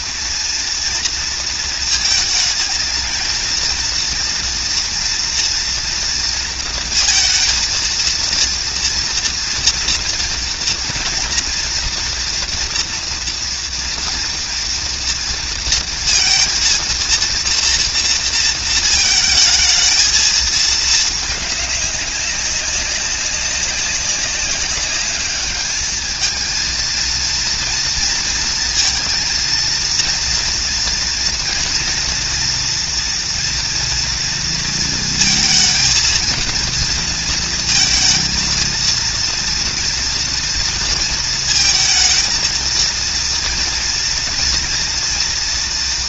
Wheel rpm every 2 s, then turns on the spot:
230, 220, 230, 230, 230, 230, 230, 230, 230, 230, 220, 200, 200, 230, 230, 230, 230, 230, 230, 230, 230, 230, 240.
none